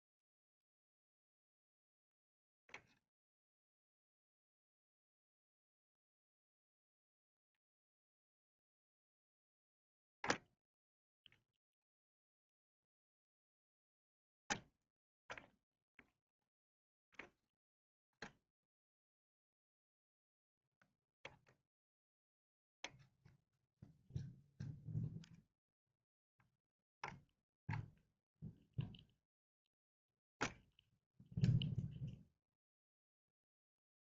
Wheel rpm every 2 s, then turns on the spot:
0, 0, 0, 0, 0, 0, 0, 0, 0, 0, 0, 0, 0, 0, 0, 0, 0.
none